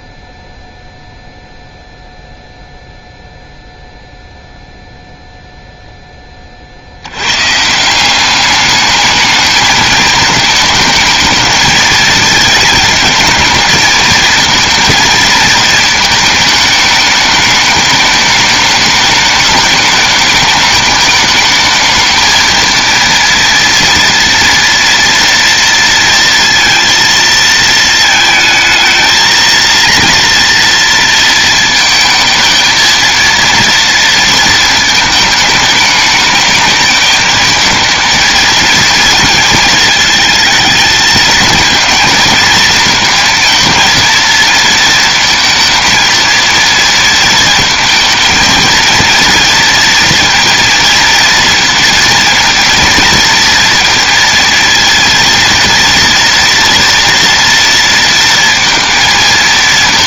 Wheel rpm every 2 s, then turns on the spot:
0, 0, 0, 40, 210, 220, 220, 220, 210, 210, 210, 230, 230, 230, 220, 230, 220, 230, 210, 230, 220, 220, 230, 230, 220, 230, 230, 230, 230, 230.
none